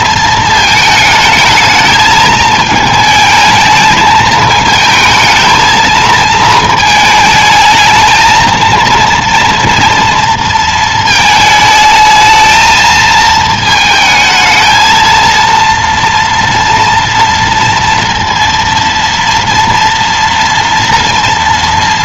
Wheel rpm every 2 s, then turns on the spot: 220, 220, 220, 220, 230, 230, 220, 220, 230, 230, 230.
none